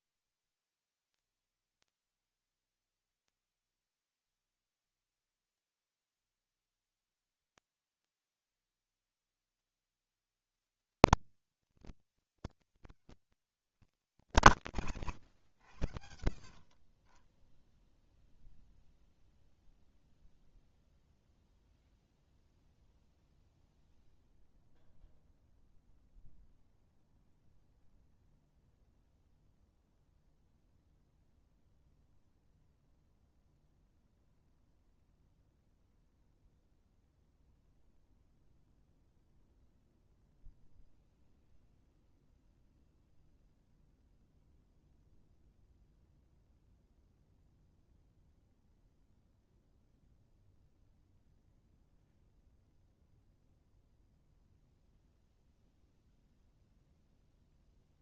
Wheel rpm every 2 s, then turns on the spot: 50, 130, 170, 90, 160, 210, 160, 150, 50, 0, 0, 0, 0, 0, 0, 0, 0, 0, 0, 0, 0, 0, 0, 0, 0, 0, 0, 0, 0.
none